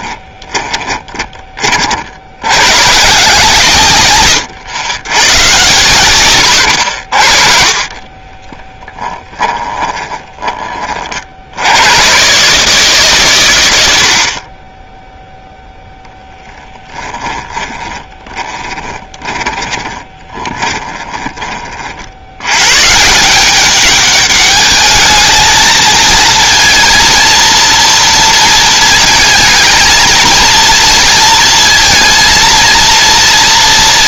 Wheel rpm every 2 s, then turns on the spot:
20, 110, 90, 100, 20, 30, 150, 20, 10, 20, 20, 160, 210, 230, 230, 230, 230.
0-2 6-10 16-22